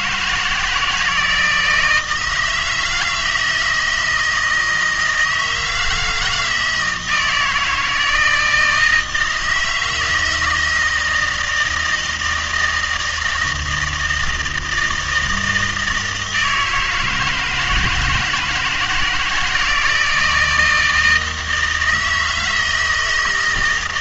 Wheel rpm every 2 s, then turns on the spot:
160, 160, 160, 160, 160, 160, 160, 160, 160, 170, 160, 160.
none